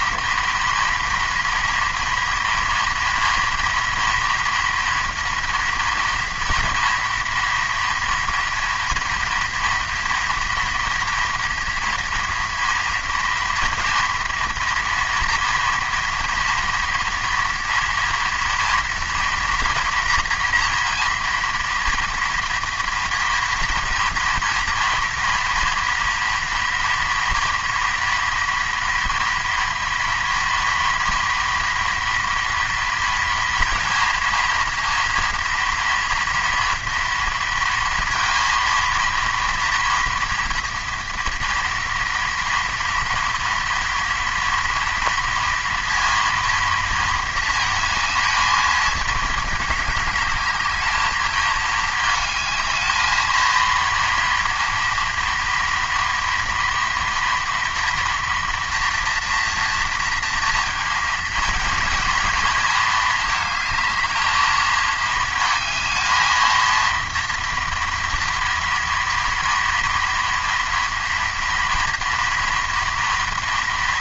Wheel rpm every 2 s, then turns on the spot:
230, 230, 230, 230, 230, 230, 230, 230, 230, 230, 230, 240, 230, 230, 230, 230, 230, 230, 230, 230, 240, 230, 230, 230, 220, 210, 220, 230, 230, 240, 230, 230, 220, 230, 230, 230, 240.
none